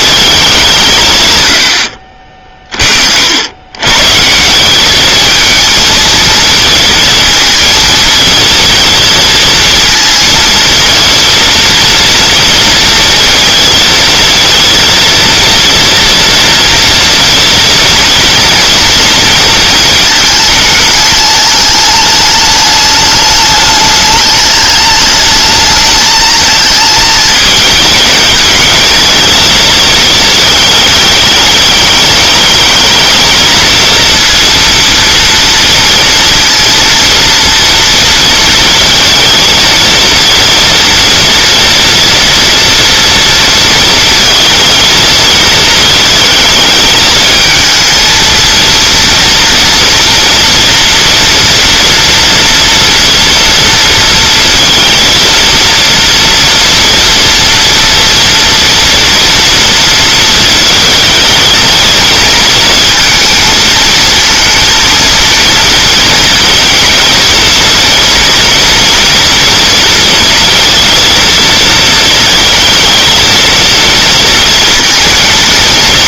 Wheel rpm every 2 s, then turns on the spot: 150, 50, 200, 220, 230, 230, 230, 230, 230, 230, 210, 210, 210, 220, 220, 210, 220, 230, 230, 230, 230, 230, 220, 220, 230, 230, 230, 230, 230, 230, 220, 230, 230, 230, 230, 230, 220, 230.
none